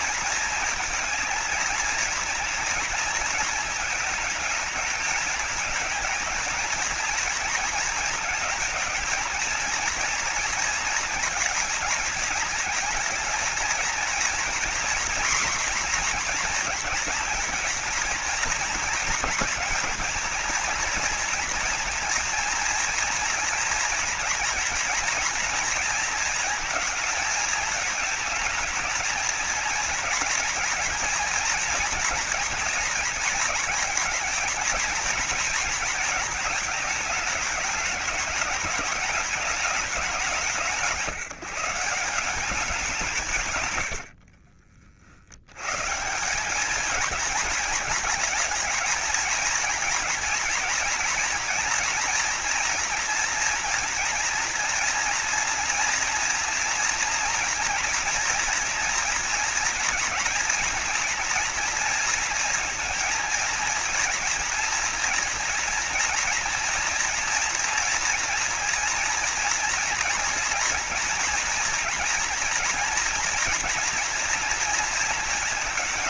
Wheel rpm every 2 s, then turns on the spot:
230, 230, 220, 230, 230, 230, 220, 240, 240, 240, 230, 230, 230, 220, 220, 230, 230, 220, 210, 220, 160, 170, 80, 220, 230, 230, 240, 230, 230, 230, 230, 230, 240, 230, 240, 240, 230, 230.
none